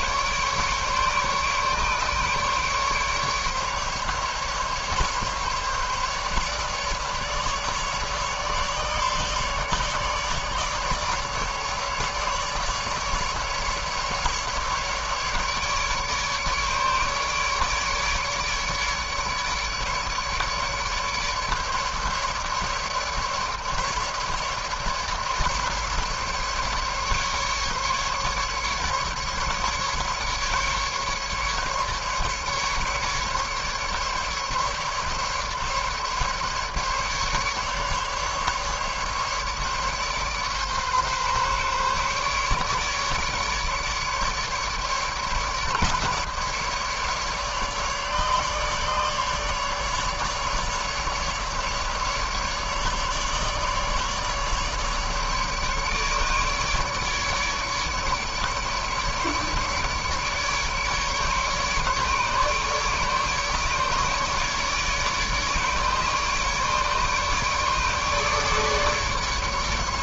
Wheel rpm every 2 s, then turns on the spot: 150, 140, 150, 150, 150, 150, 150, 150, 150, 150, 150, 150, 150, 150, 150, 150, 150, 150, 140, 140, 140, 140, 150, 140, 150, 150, 150, 150, 150, 150, 150, 150, 150, 150, 150.
none